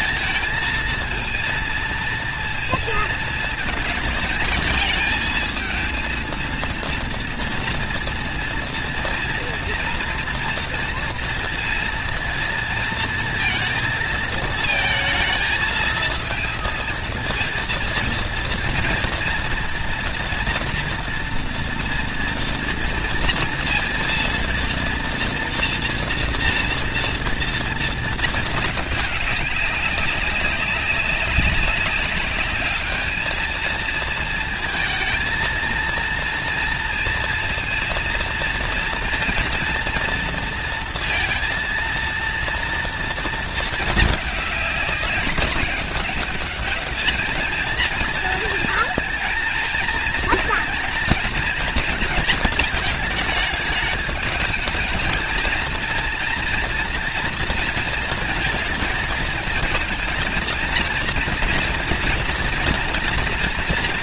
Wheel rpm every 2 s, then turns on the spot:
220, 230, 230, 230, 230, 230, 230, 220, 230, 230, 240, 230, 230, 230, 220, 190, 200, 220, 230, 230, 230, 230, 210, 210, 230, 230, 220, 220, 230, 220, 230, 230.
none